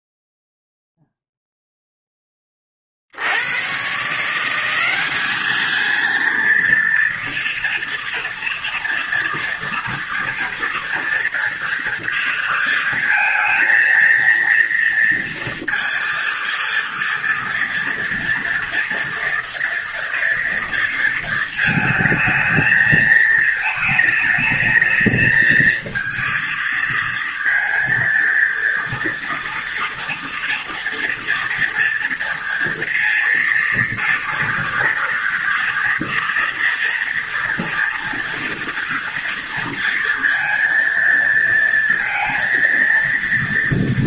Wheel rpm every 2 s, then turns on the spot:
0, 20, 180, 230, 230, 230, 230, 230, 230, 230, 230, 220, 220, 230, 230, 230, 230, 230, 240, 230, 230, 230.
none